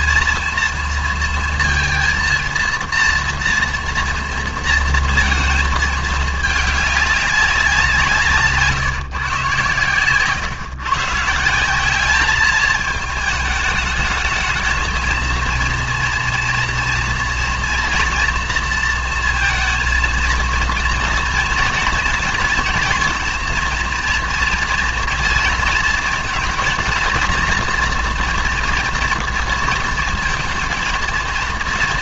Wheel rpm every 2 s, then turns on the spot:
230, 230, 230, 210, 160, 130, 220, 220, 230, 230, 230, 240, 230, 230, 230, 230.
none